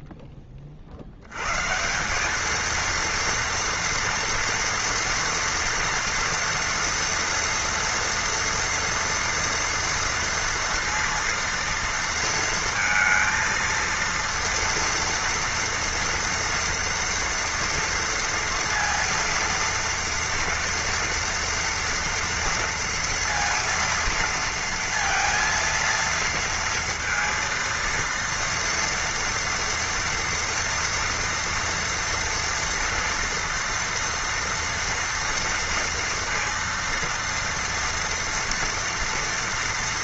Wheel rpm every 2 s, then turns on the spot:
40, 220, 230, 230, 230, 230, 230, 230, 230, 230, 230, 230, 230, 230, 230, 240, 230, 240, 230, 230.
none